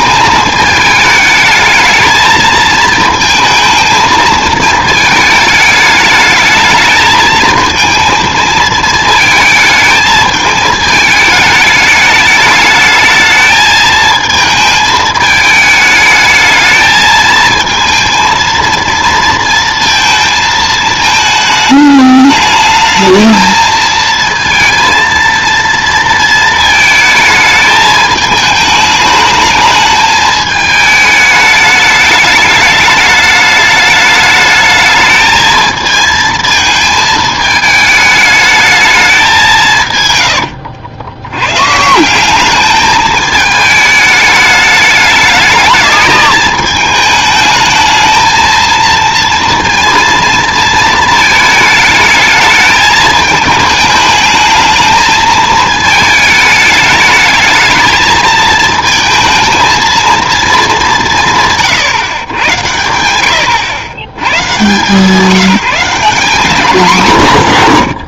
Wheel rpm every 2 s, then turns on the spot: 210, 220, 220, 210, 220, 210, 220, 230, 220, 220, 230, 220, 210, 210, 210, 220, 220, 190, 90, 210, 210, 210, 230, 220, 220, 220, 220, 220, 160, 90, 150, 200, 0, 50.
none